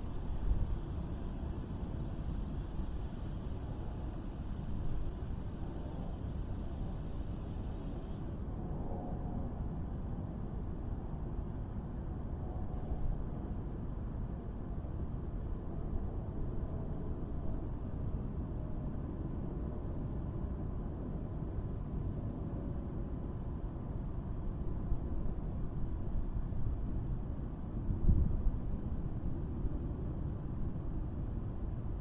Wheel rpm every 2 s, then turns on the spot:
0, 0, 0, 0, 0, 0, 0, 0, 0, 0, 0, 0, 0, 0, 0, 0.
none